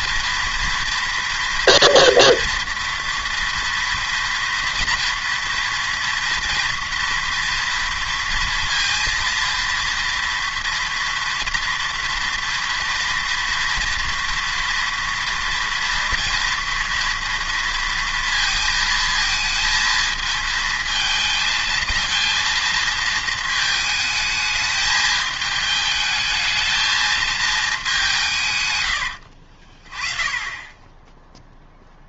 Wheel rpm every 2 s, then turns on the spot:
230, 230, 230, 230, 230, 230, 230, 230, 230, 230, 220, 230, 210, 220, 110, 20.
none